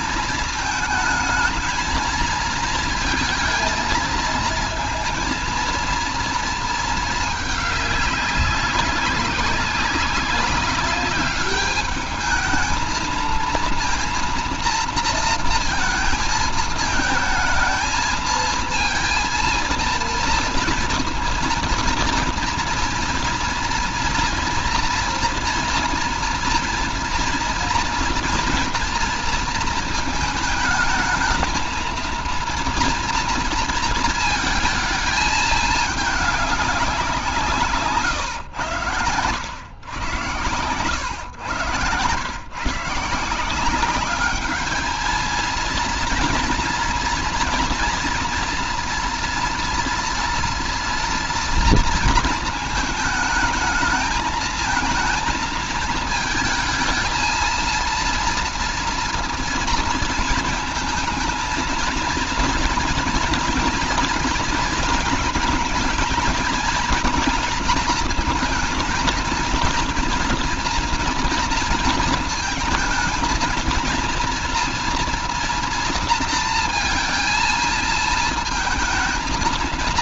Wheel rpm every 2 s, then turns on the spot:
220, 230, 230, 220, 190, 200, 230, 230, 220, 230, 230, 230, 230, 230, 230, 230, 230, 220, 180, 110, 110, 160, 220, 240, 230, 240, 220, 220, 220, 230, 220, 230, 230, 230, 230, 230, 220, 230, 230, 230.
none